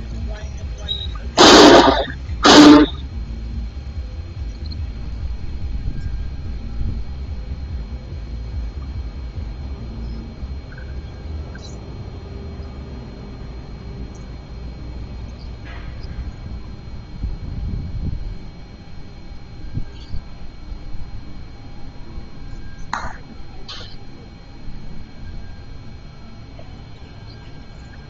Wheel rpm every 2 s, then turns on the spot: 0, 0, 0, 0, 0, 0, 0, 0, 0, 0, 0, 0, 0, 0.
none